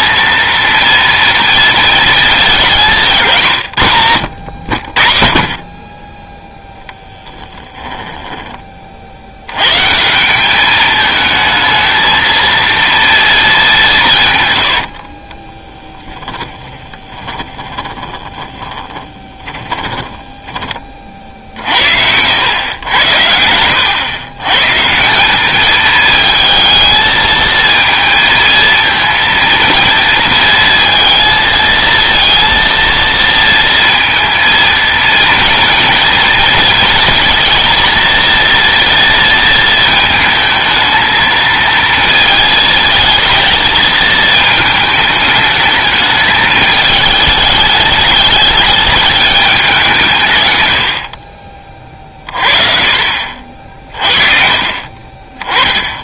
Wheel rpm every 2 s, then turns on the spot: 230, 180, 70, 0, 40, 210, 230, 80, 20, 10, 30, 100, 150, 220, 230, 230, 230, 230, 230, 230, 220, 220, 220, 210, 210, 90, 50, 30.
14-20